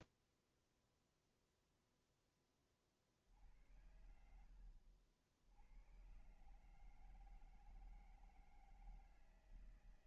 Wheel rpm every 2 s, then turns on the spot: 0, 10, 90, 120, 160.
none